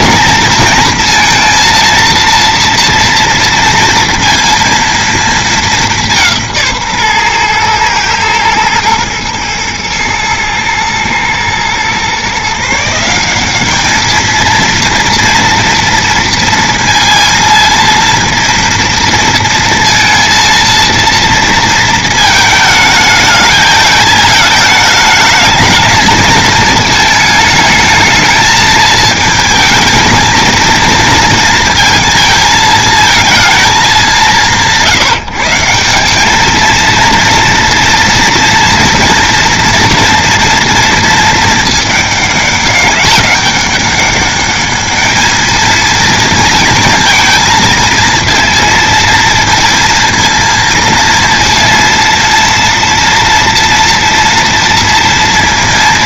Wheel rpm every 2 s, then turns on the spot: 220, 230, 230, 150, 110, 110, 160, 230, 230, 230, 230, 220, 210, 220, 220, 230, 220, 150, 230, 240, 230, 200, 210, 230, 230, 230, 230, 230.
none